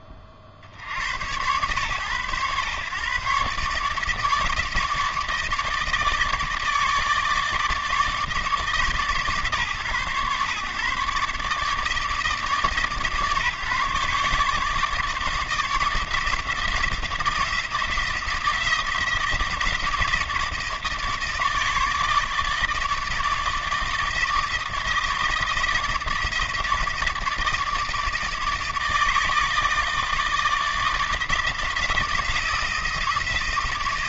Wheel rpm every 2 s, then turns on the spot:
50, 120, 160, 160, 160, 140, 150, 150, 160, 170, 160, 150, 160, 160, 160, 160, 170.
none